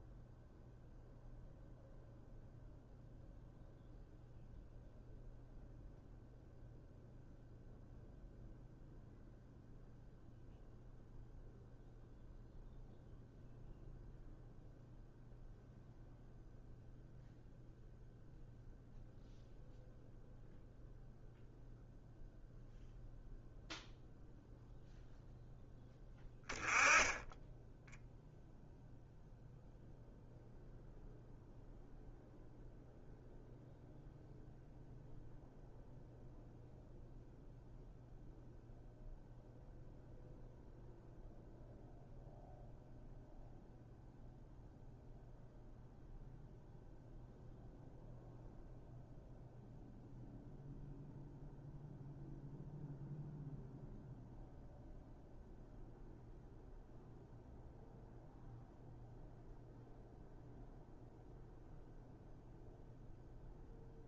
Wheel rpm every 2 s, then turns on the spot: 0, 0, 0, 0, 0, 0, 0, 0, 0, 0, 0, 0, 0, 10, 0, 0, 0, 0, 0, 0, 0, 0, 0, 0, 0, 0, 0, 0, 0, 0, 0, 0.
none